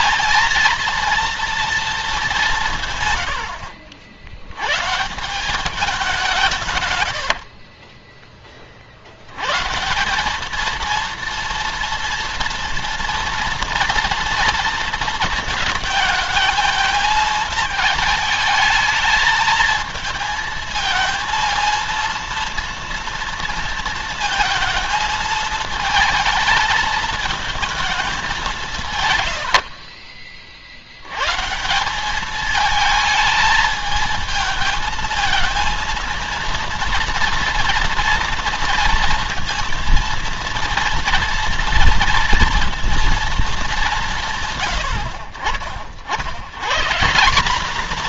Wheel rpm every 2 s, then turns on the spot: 230, 150, 130, 140, 50, 220, 230, 230, 220, 220, 230, 230, 220, 220, 160, 70, 220, 220, 230, 230, 230, 230, 90, 150.
none